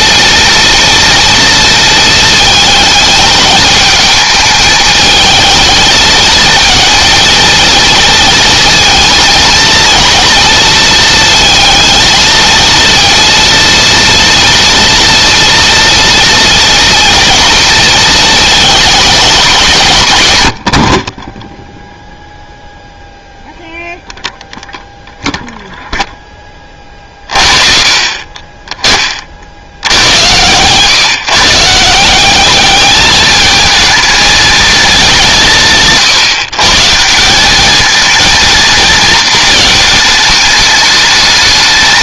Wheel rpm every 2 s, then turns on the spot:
230, 220, 220, 220, 230, 230, 230, 230, 230, 210, 50, 0, 0, 30, 30, 130, 210, 210, 160, 230, 210.
none